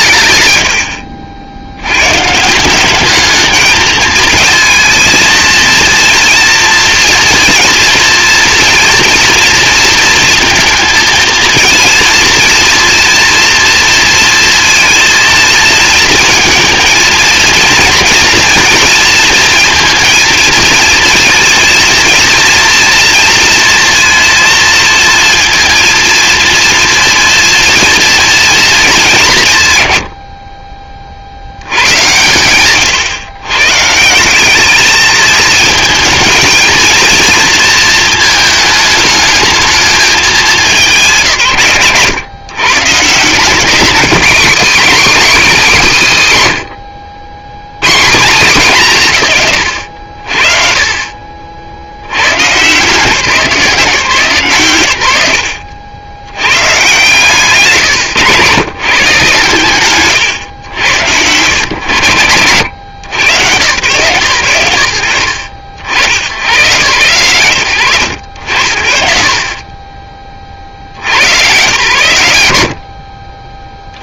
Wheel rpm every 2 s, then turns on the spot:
120, 200, 230, 230, 230, 230, 240, 230, 230, 230, 230, 230, 230, 230, 200, 40, 130, 210, 230, 220, 170, 150, 220, 80, 170, 40, 150, 110, 160, 100, 90, 90, 90, 130, 80, 60, 80.
none